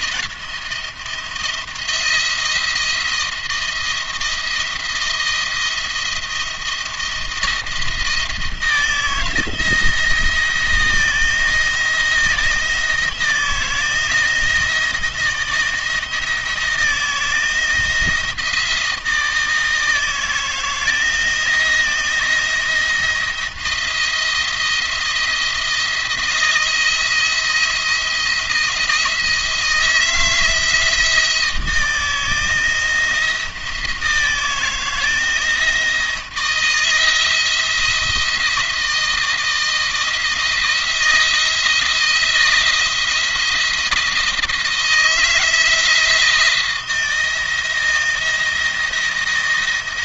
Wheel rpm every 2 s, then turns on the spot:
170, 170, 170, 170, 170, 170, 170, 170, 160, 170, 160, 170, 170, 160, 170, 160, 170, 160, 160, 160, 160, 160, 160, 160, 170.
none